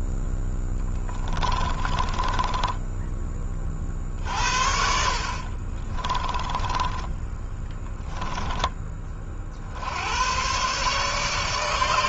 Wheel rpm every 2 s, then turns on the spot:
10, 10, 60, 20, 20, 130.
0-8